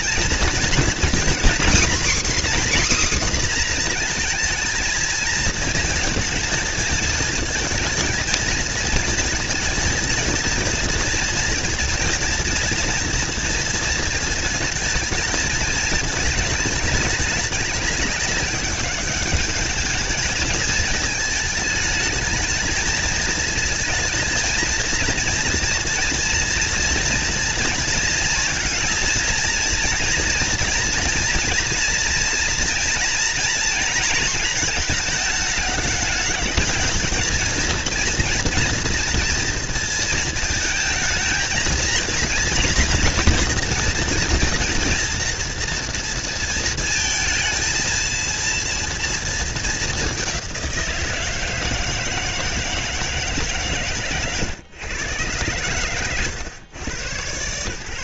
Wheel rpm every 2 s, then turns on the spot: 230, 270, 230, 220, 220, 230, 230, 220, 210, 210, 220, 220, 230, 230, 230, 230, 240, 220, 210, 230, 220, 240, 230, 220, 230, 170, 160, 130, 120.
none